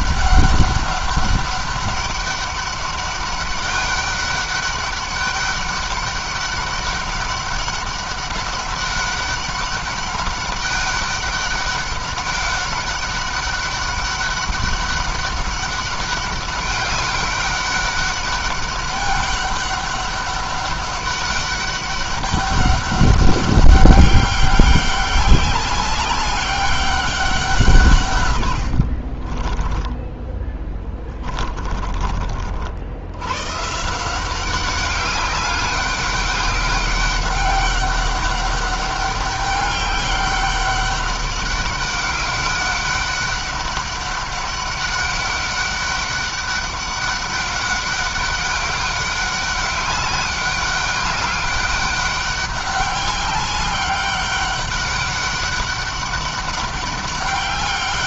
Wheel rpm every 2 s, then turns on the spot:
200, 200, 200, 200, 200, 200, 200, 200, 200, 200, 200, 200, 200, 200, 50, 20, 90, 200, 200, 200, 200, 200, 200, 200, 200, 200, 200, 200, 200.
28-32